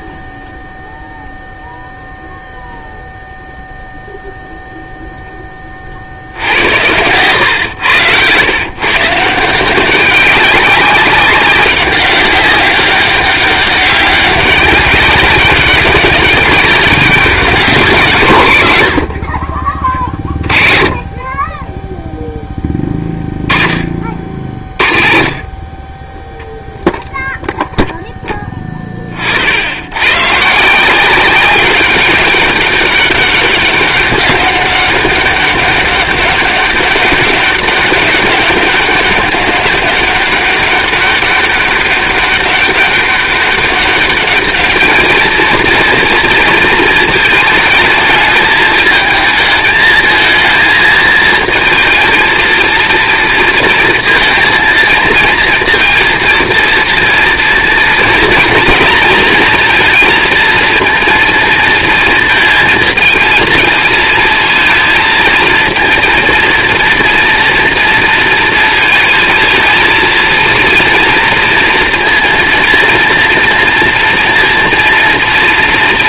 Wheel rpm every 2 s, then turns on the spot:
0, 0, 0, 90, 120, 200, 190, 200, 200, 150, 30, 10, 50, 0, 20, 160, 200, 200, 200, 200, 200, 200, 220, 230, 220, 220, 230, 230, 230, 230, 230, 220, 230, 230, 220, 230, 230, 230.
20-22